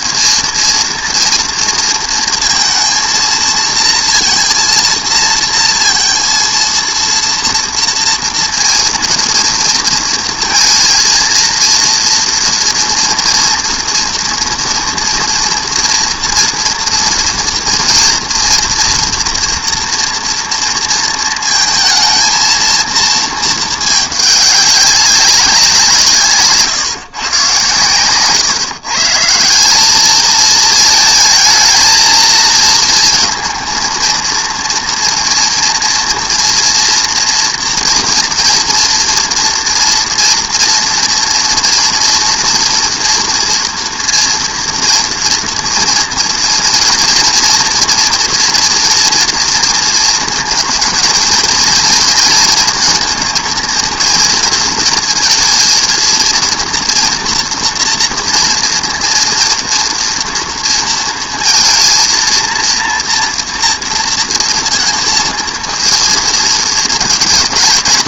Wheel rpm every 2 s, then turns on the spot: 230, 230, 230, 230, 230, 230, 230, 230, 230, 240, 230, 220, 200, 150, 140, 220, 230, 230, 240, 230, 240, 230, 230, 230, 230, 220, 230, 230, 230, 230, 230, 240, 230, 220.
none